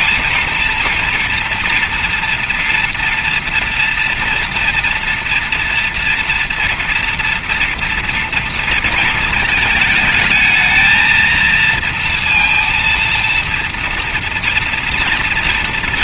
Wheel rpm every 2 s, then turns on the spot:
230, 240, 230, 230, 230, 220, 230, 230.
none